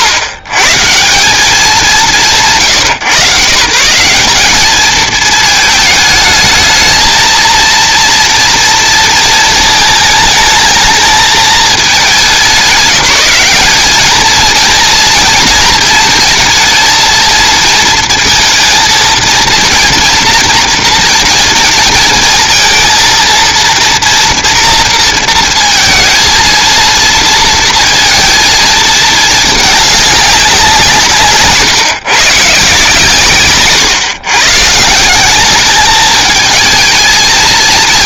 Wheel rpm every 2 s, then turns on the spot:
100, 120, 210, 220, 230, 220, 190, 230, 220, 230, 230, 230, 230, 230, 220, 180, 150, 150, 220.
none